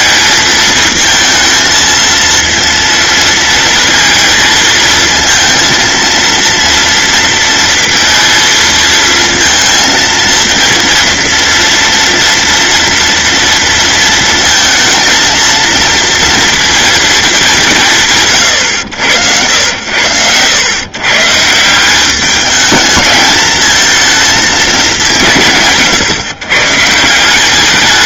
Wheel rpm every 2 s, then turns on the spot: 220, 230, 230, 230, 230, 230, 230, 230, 230, 100, 130, 210, 200, 140.
none